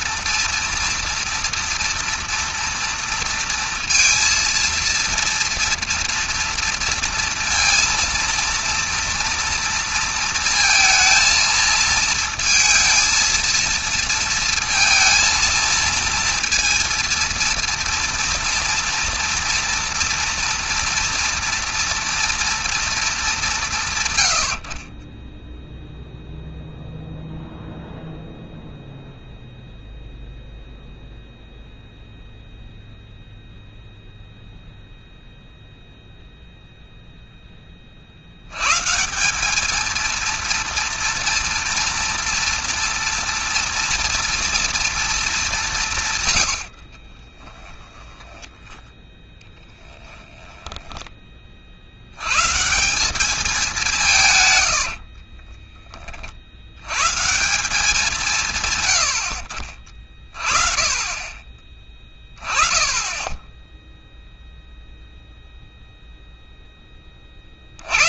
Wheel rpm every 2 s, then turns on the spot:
230, 230, 230, 230, 230, 230, 230, 230, 230, 230, 230, 220, 50, 0, 0, 0, 0, 0, 0, 140, 230, 230, 230, 80, 10, 10, 160, 100, 80, 140, 30, 30, 0, 10.
46-52 54-56